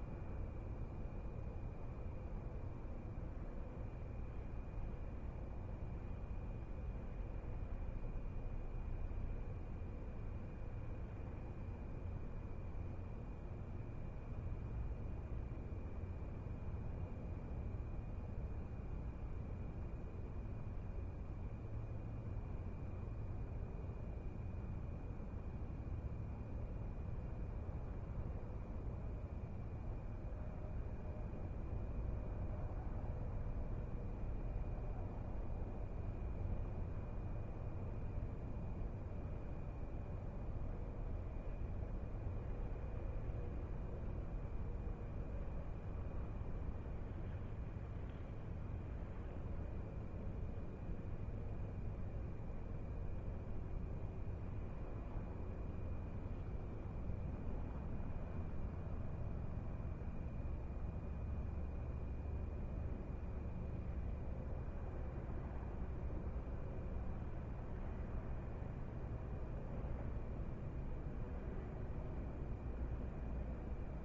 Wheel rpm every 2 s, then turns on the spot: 0, 0, 0, 0, 0, 0, 0, 0, 0, 0, 0, 0, 0, 0, 0, 0, 0, 0, 0, 0, 0, 0, 0, 0, 0, 0, 0, 0, 0, 0, 0, 0, 0, 0, 0, 0, 0.
none